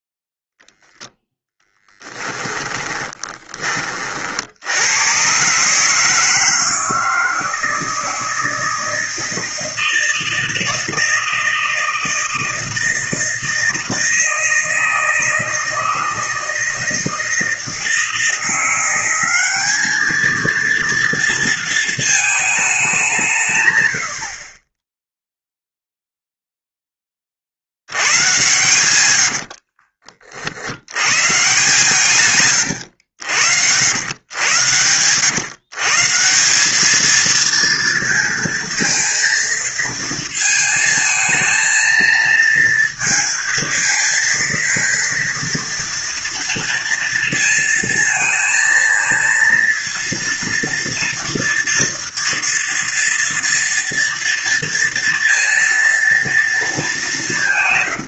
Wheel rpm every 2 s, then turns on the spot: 0, 10, 70, 160, 160, 160, 160, 160, 160, 170, 230, 210, 30, 0, 110, 70, 130, 110, 190, 230, 230, 230, 230, 230, 230, 230, 230, 230, 230.
2-4 28-30